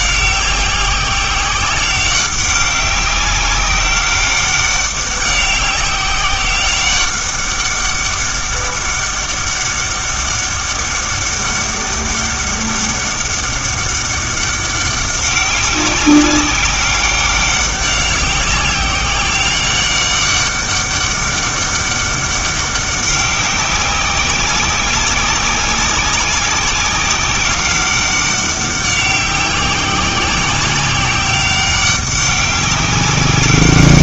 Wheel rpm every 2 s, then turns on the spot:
190, 190, 200, 200, 200, 200, 200, 190, 200, 190, 200, 200, 190, 190, 190, 190, 200.
none